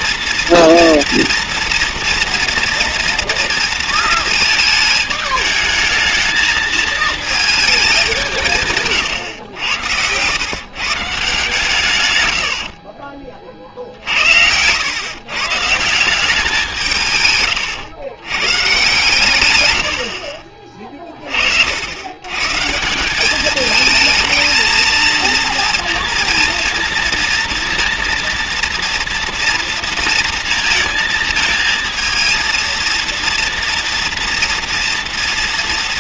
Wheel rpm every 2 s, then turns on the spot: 240, 240, 220, 220, 150, 120, 90, 90, 180, 130, 40, 150, 230, 230, 230, 230, 230, 240.
none